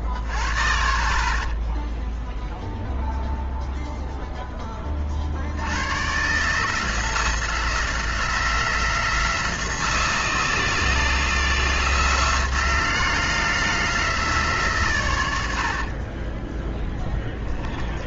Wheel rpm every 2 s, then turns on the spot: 40, 0, 20, 150, 160, 160, 160, 130, 10.
0-2